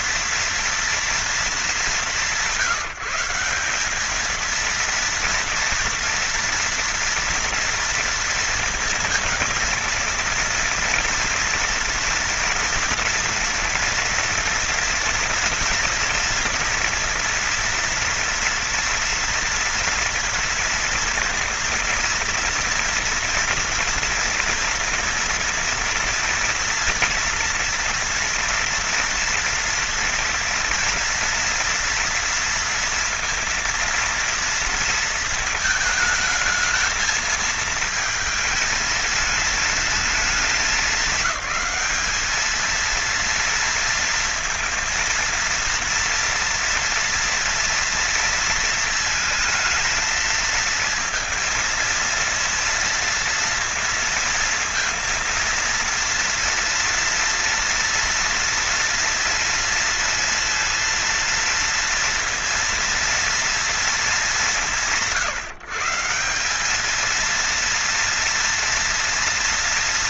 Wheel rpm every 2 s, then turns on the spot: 230, 170, 230, 230, 230, 230, 230, 230, 230, 230, 230, 230, 230, 230, 230, 240, 230, 230, 220, 220, 220, 220, 230, 230, 230, 220, 230, 230, 230, 230, 230, 230, 140, 210, 230.
none